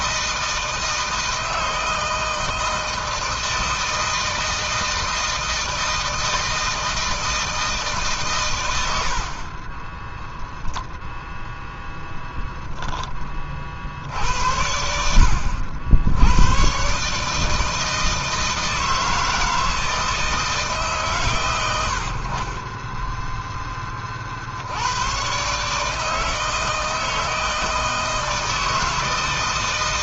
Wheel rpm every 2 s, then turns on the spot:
160, 160, 160, 160, 120, 0, 0, 80, 110, 160, 160, 50, 60, 160, 160.
none